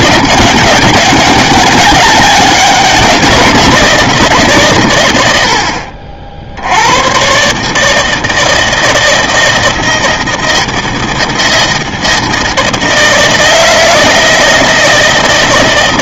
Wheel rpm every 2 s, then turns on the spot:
200, 190, 140, 60, 160, 170, 160, 160.
none